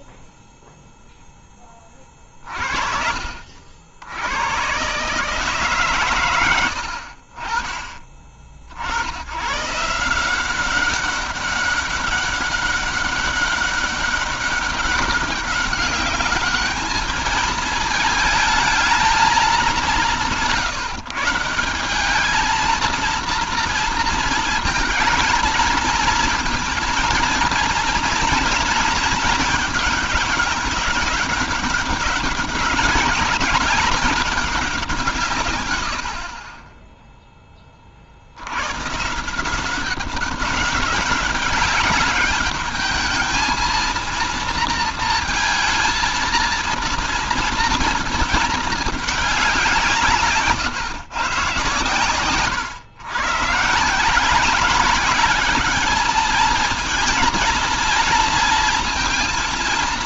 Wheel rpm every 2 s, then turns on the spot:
70, 120, 30, 160, 200, 200, 200, 220, 180, 190, 230, 220, 230, 210, 200, 200, 90, 30, 180, 200, 220, 230, 230, 180, 120, 140, 210, 230, 230, 230.
none